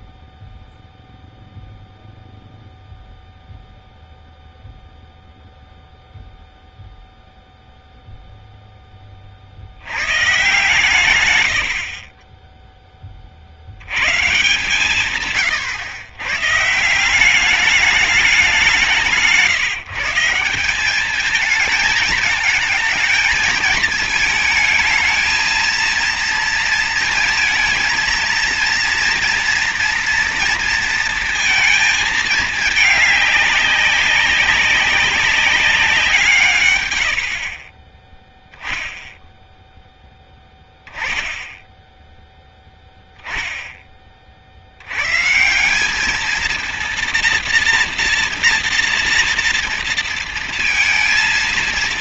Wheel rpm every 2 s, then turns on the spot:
0, 0, 0, 0, 10, 110, 30, 130, 170, 170, 210, 230, 220, 230, 230, 230, 210, 190, 100, 0, 10, 10, 80, 230, 230, 230.
none